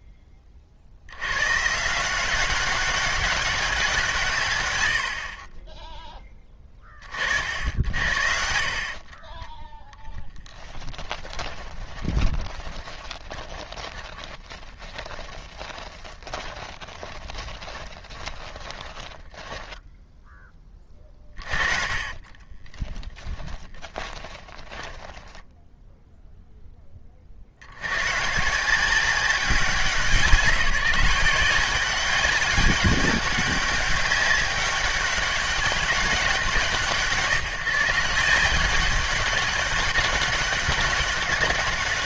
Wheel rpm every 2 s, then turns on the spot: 50, 190, 110, 20, 40, 10, 20, 30, 20, 20, 20, 20, 10, 10, 170, 170, 200, 200, 160, 190, 200.
8-20 22-26